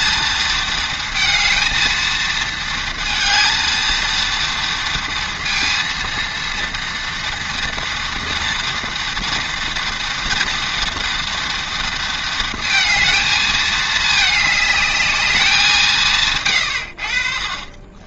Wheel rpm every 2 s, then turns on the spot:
220, 220, 230, 230, 230, 240, 230, 210, 110.
16-18